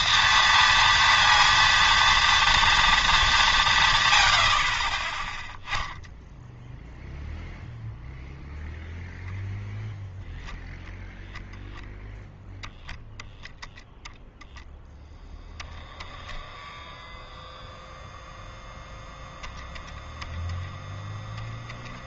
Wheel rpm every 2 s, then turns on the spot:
230, 230, 50, 0, 0, 0, 0, 0, 0, 0, 10.
none